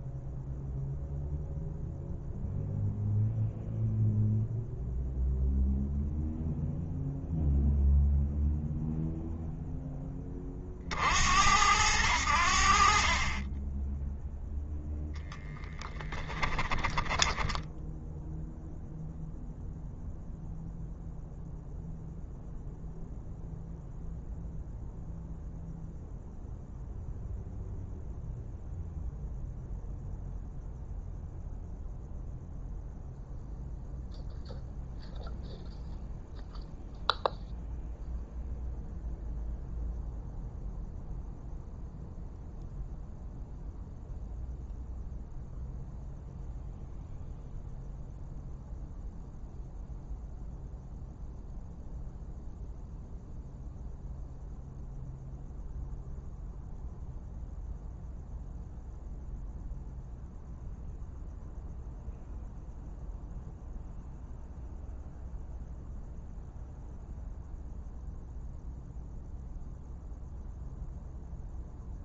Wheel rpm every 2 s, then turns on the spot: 0, 0, 0, 0, 0, 60, 50, 0, 10, 0, 0, 0, 0, 0, 0, 0, 0, 0, 0, 0, 0, 0, 0, 0, 0, 0, 0, 0, 0, 0, 0, 0, 0, 0, 0, 0.
none